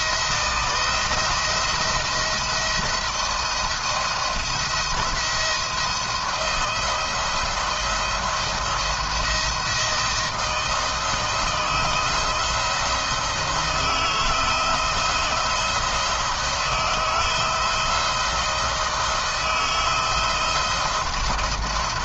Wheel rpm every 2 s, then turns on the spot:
170, 170, 170, 160, 160, 160, 160, 170, 160, 170, 170.
none